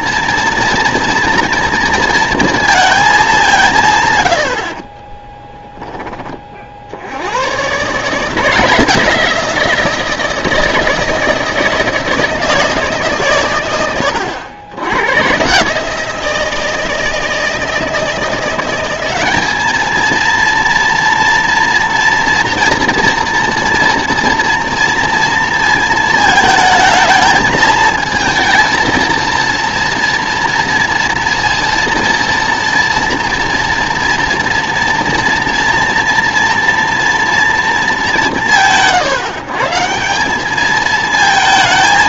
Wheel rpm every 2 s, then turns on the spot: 230, 230, 50, 40, 160, 160, 160, 90, 160, 180, 230, 230, 230, 220, 220, 230, 230, 230, 240, 160, 210.
4-6